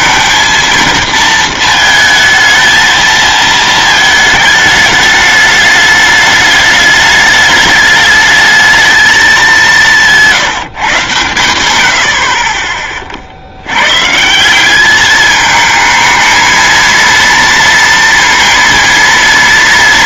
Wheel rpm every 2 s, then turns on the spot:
230, 230, 210, 210, 220, 160, 30, 190, 220, 230.
none